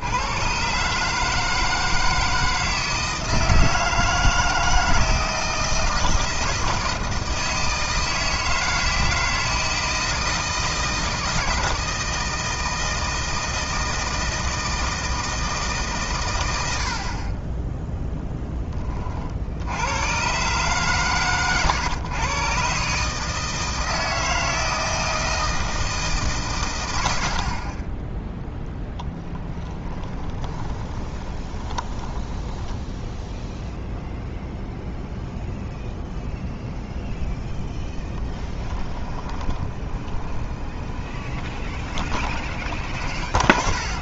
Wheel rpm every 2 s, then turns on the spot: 130, 160, 160, 160, 160, 160, 160, 160, 90, 30, 120, 140, 160, 110, 0, 20, 10, 0, 0, 20, 20, 20.
30-34 38-44